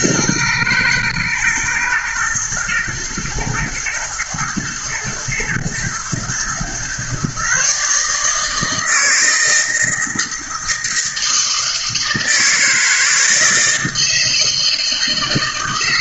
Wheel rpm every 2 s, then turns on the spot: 110, 120, 120, 130, 160, 160, 160, 160.
none